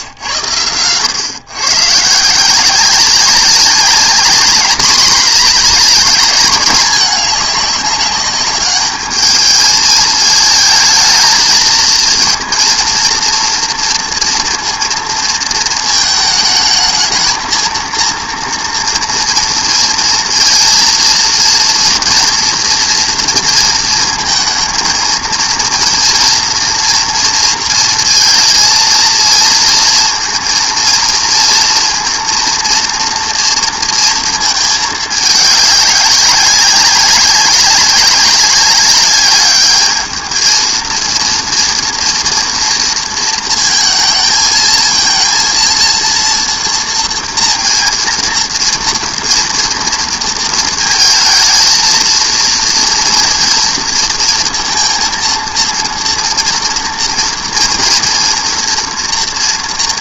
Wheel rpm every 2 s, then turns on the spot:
100, 170, 200, 210, 210, 220, 230, 230, 220, 230, 230, 240, 230, 230, 230, 230, 230, 220, 200, 200, 220, 230, 220, 230, 230, 220, 230, 230, 230, 240.
none